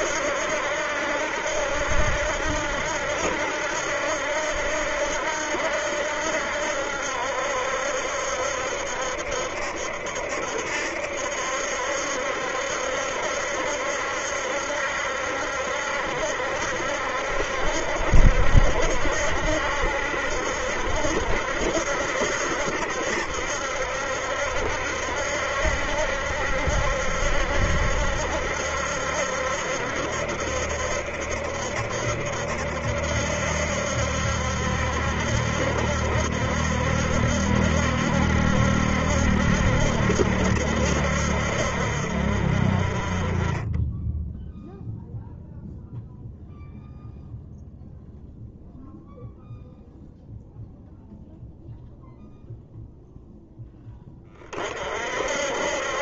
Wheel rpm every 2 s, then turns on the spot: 70, 70, 70, 70, 70, 70, 70, 70, 70, 70, 70, 70, 70, 70, 70, 70, 70, 70, 70, 70, 70, 40, 0, 0, 0, 0, 0, 60.
none